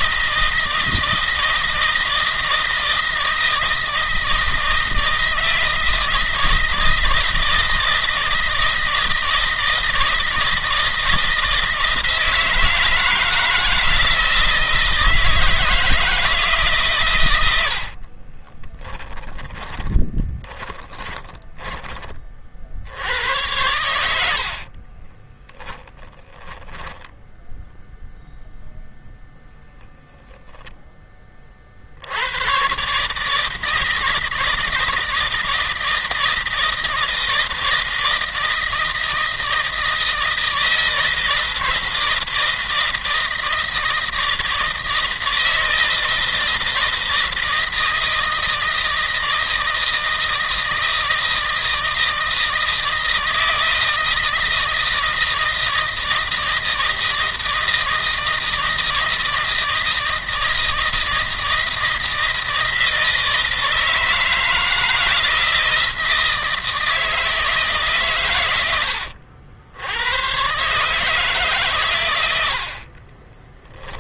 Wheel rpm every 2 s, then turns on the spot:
160, 160, 160, 160, 160, 160, 160, 160, 140, 20, 20, 80, 30, 10, 0, 10, 140, 160, 160, 160, 160, 160, 160, 160, 160, 160, 160, 160, 160, 160, 160, 160, 160, 160, 90, 150, 40.
18-22 24-28 72-74